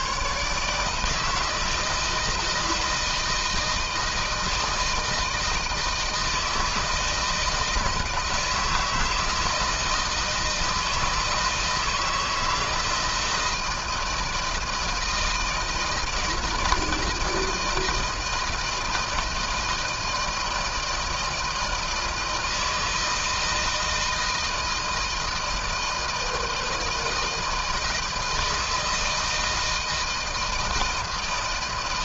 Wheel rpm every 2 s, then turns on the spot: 130, 170, 160, 160, 160, 160, 160, 160, 160, 160, 160, 160, 160, 160, 160, 160.
none